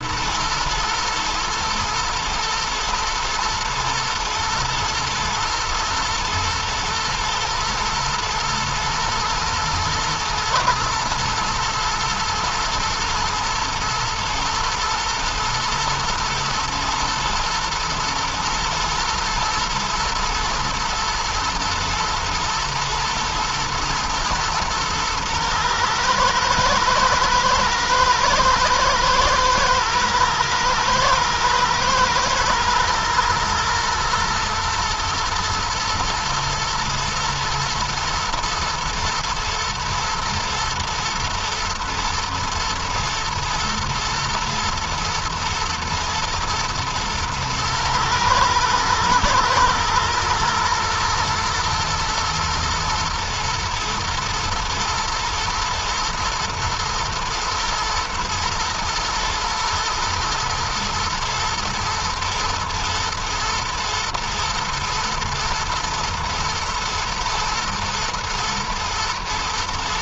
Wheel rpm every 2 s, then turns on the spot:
110, 120, 110, 110, 110, 110, 110, 120, 120, 120, 110, 120, 110, 110, 120, 110, 120, 120, 110, 110, 120, 110, 110, 110, 110, 120, 120, 120, 120, 120, 110, 110, 120, 110, 120.
none